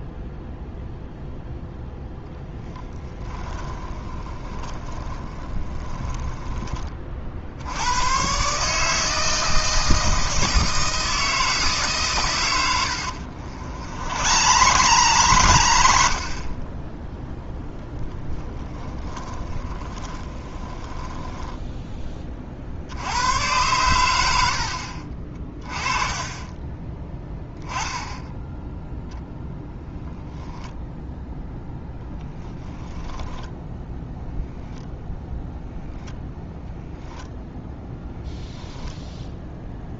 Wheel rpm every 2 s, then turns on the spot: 0, 10, 20, 20, 140, 160, 100, 120, 10, 10, 20, 50, 80, 20, 0, 0, 10, 0, 0, 10.
2-6 12-16 18-22 26-28